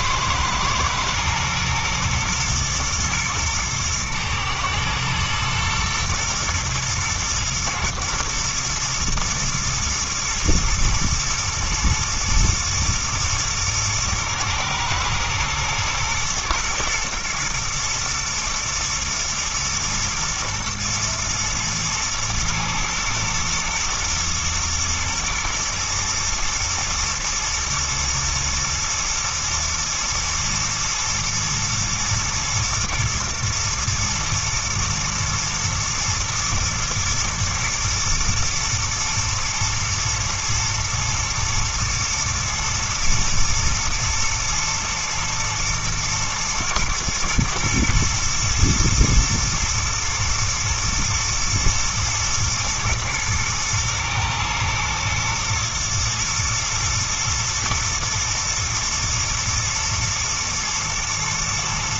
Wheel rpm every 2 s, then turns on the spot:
120, 120, 120, 120, 110, 110, 110, 110, 110, 110, 110, 110, 110, 110, 110, 110, 120, 120, 120, 120, 110, 120, 110, 120, 110, 110, 110, 110, 110, 120, 120.
none